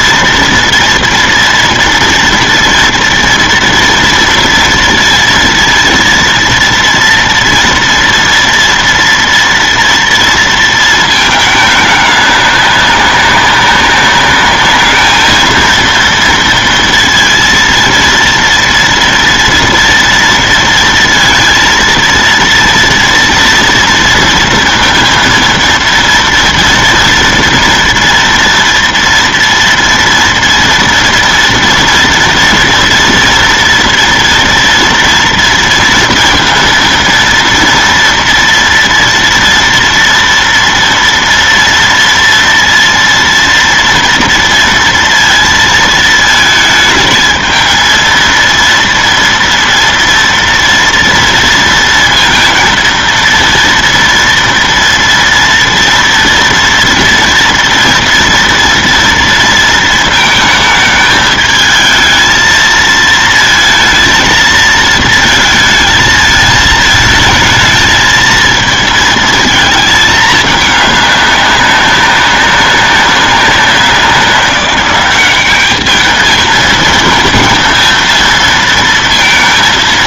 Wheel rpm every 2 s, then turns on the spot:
230, 230, 230, 230, 230, 230, 200, 210, 230, 230, 230, 230, 230, 240, 230, 230, 230, 230, 230, 230, 230, 230, 230, 220, 230, 230, 230, 230, 230, 240, 220, 220, 230, 220, 220, 210, 200, 190, 220, 230.
none